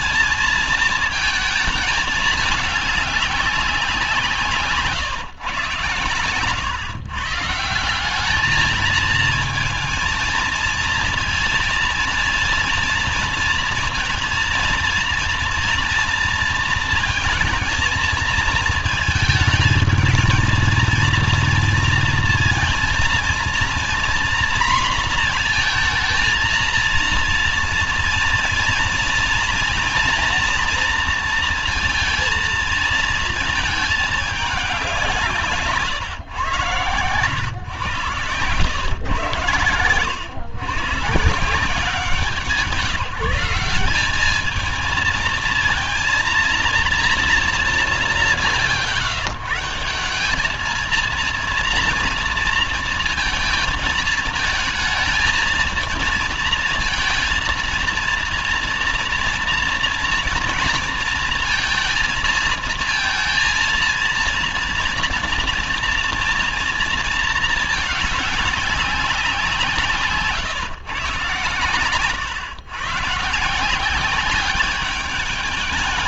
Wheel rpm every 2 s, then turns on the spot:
230, 210, 170, 120, 210, 220, 230, 230, 230, 220, 220, 230, 240, 230, 230, 230, 230, 200, 130, 120, 120, 170, 220, 230, 130, 210, 230, 220, 230, 230, 230, 230, 230, 230, 200, 140, 130, 200.
4-6